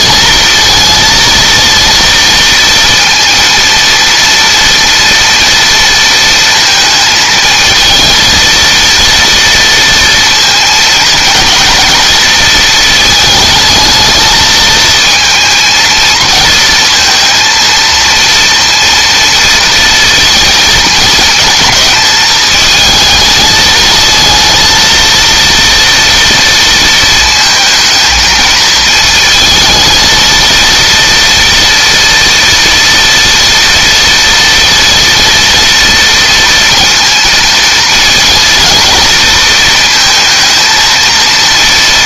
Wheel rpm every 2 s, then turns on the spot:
230, 230, 230, 220, 230, 220, 220, 230, 230, 230, 220, 220, 230, 230, 220, 230, 240, 230, 230, 230, 230.
none